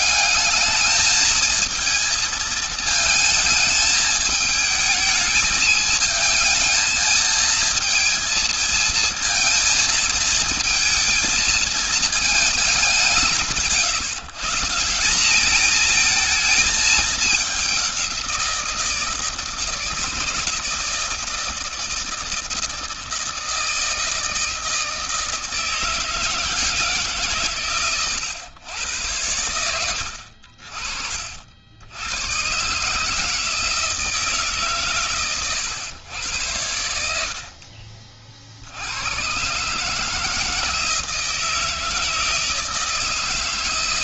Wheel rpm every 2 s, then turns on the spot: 210, 220, 220, 220, 220, 220, 200, 160, 220, 170, 160, 160, 160, 160, 110, 60, 120, 140, 80, 60, 160, 160.
none